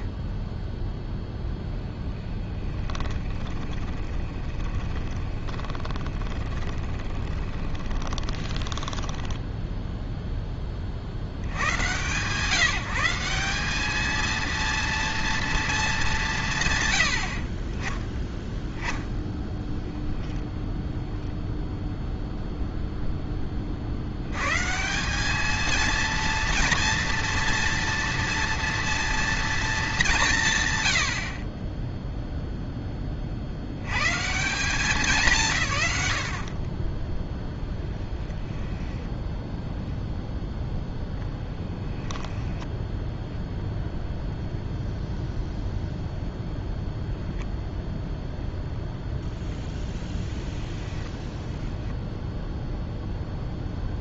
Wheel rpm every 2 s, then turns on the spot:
0, 30, 20, 20, 10, 20, 160, 230, 140, 10, 0, 0, 160, 230, 230, 140, 10, 180, 30, 10, 0, 10, 0, 0, 0, 0, 0.
2-8 38-40 42-44